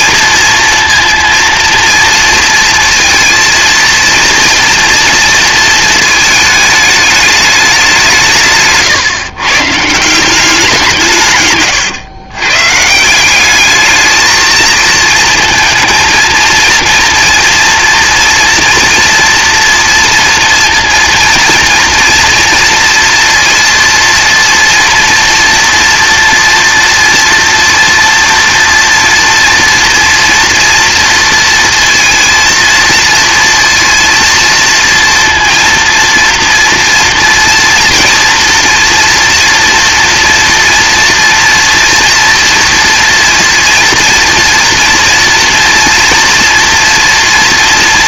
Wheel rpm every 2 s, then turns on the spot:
230, 230, 230, 210, 150, 180, 150, 220, 230, 240, 230, 230, 230, 230, 230, 240, 230, 230, 230, 240, 230, 230, 230, 230.
8-10